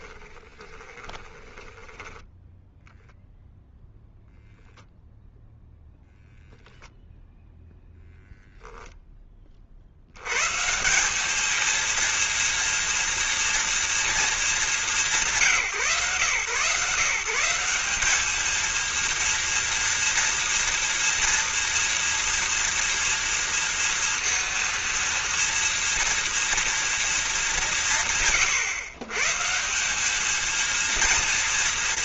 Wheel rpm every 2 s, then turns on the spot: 20, 0, 0, 0, 0, 190, 230, 190, 160, 230, 230, 230, 230, 220, 130, 230.
0-2